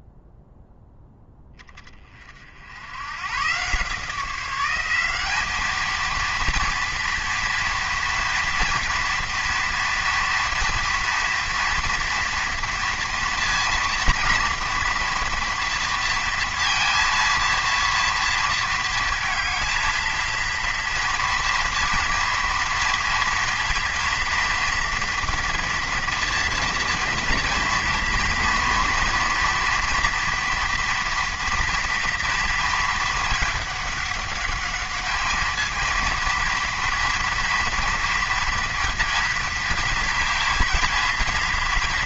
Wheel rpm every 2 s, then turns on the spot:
0, 80, 190, 230, 230, 230, 230, 230, 230, 230, 230, 230, 230, 230, 230, 230, 220, 210, 230, 230, 230.
none